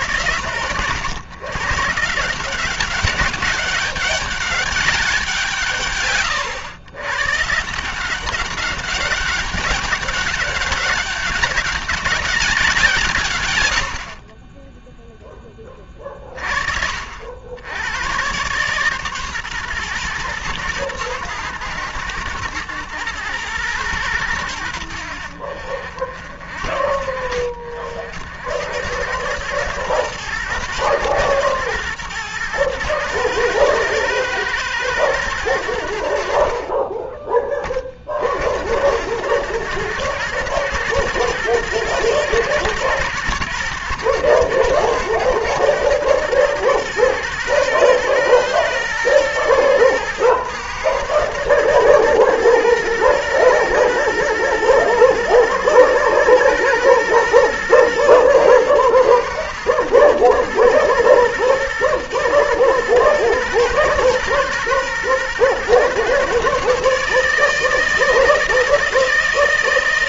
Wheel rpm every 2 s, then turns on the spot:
120, 200, 140, 140, 200, 200, 100, 10, 80, 130, 120, 110, 60, 60, 100, 110, 110, 100, 20, 100, 110, 110, 110, 110, 110, 110, 110, 110, 110, 110, 120, 120, 120, 150, 160.
none